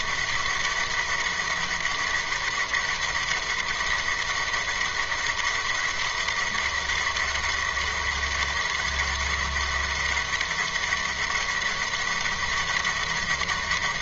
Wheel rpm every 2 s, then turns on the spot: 200, 200, 200, 200, 200, 200, 200.
none